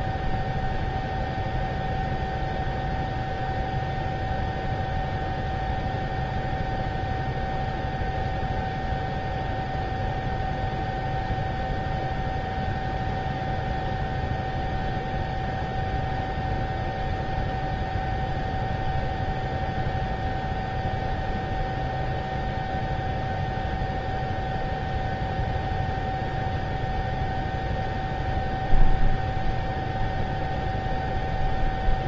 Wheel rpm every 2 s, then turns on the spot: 0, 0, 0, 0, 0, 0, 0, 0, 0, 0, 0, 0, 0, 0, 0, 0.
none